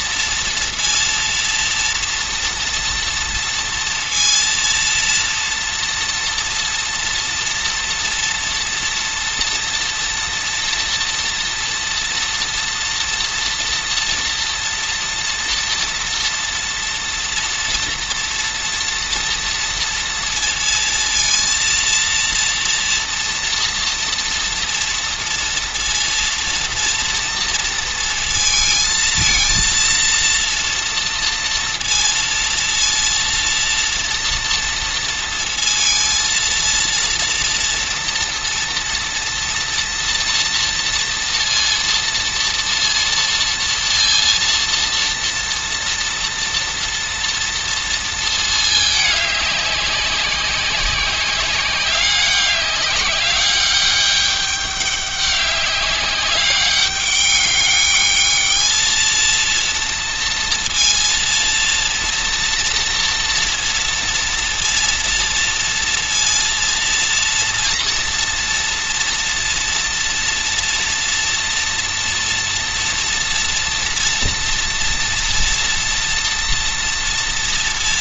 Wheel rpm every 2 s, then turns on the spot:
230, 230, 230, 230, 240, 240, 230, 240, 230, 230, 230, 230, 230, 230, 230, 230, 230, 230, 230, 230, 230, 230, 230, 230, 220, 190, 200, 200, 200, 220, 230, 230, 230, 230, 230, 230, 230, 230, 230.
none